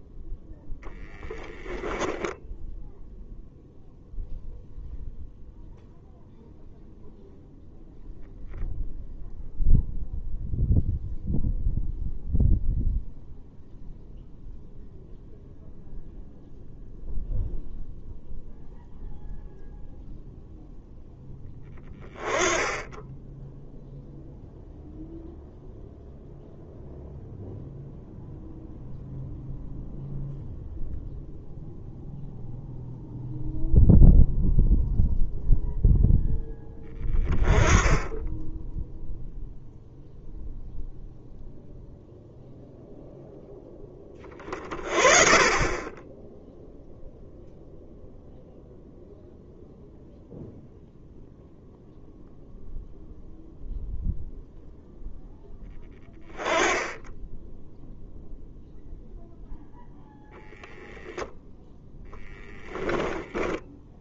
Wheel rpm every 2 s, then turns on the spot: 0, 0, 0, 0, 0, 0, 0, 0, 0, 0, 0, 10, 0, 0, 0, 0, 0, 0, 10, 0, 0, 0, 40, 0, 0, 0, 0, 0, 10, 0, 0, 10.
none